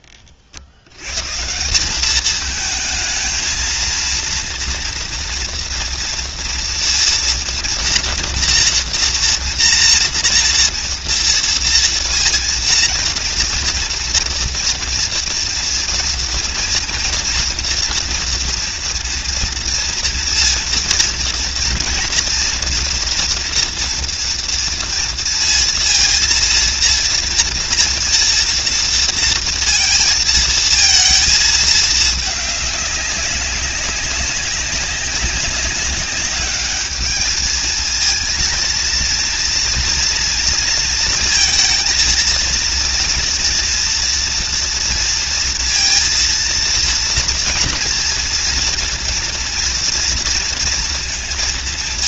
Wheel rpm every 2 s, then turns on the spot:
60, 220, 230, 230, 240, 230, 230, 230, 230, 230, 230, 230, 230, 230, 230, 230, 200, 190, 210, 230, 230, 230, 230, 230, 230, 230.
none